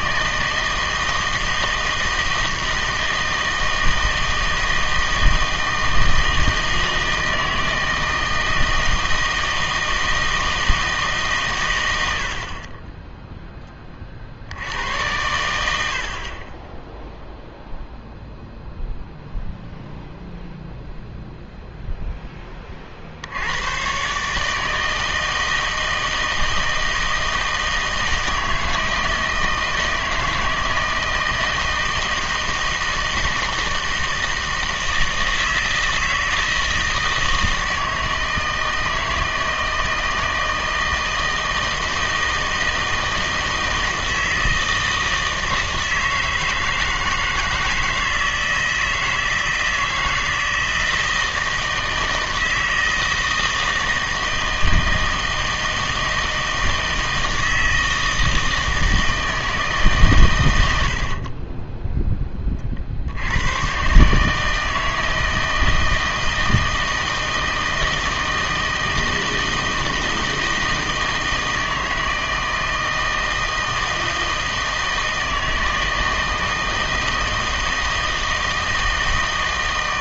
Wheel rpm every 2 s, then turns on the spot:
160, 160, 160, 160, 160, 160, 40, 80, 20, 0, 0, 20, 160, 160, 160, 160, 160, 160, 160, 160, 160, 160, 160, 160, 160, 160, 160, 160, 160, 160, 90, 40, 160, 160, 160, 160, 160, 160, 160, 160.
none